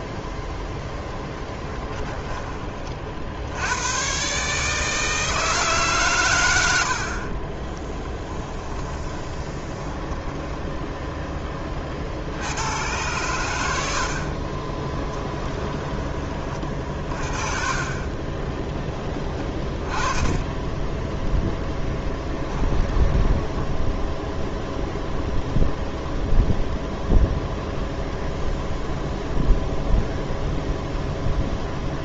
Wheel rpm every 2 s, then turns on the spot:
0, 30, 150, 80, 20, 0, 100, 20, 30, 20, 10, 10, 0, 0, 0, 0.
8-10 14-16 22-24